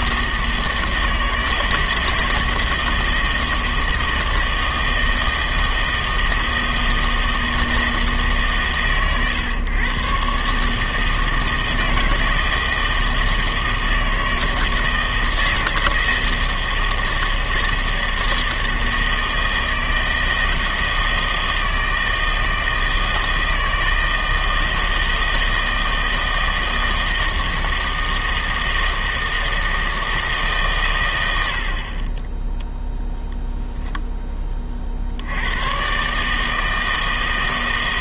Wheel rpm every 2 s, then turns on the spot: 160, 160, 160, 160, 140, 140, 160, 160, 160, 160, 160, 160, 160, 160, 160, 150, 10, 30, 160.
none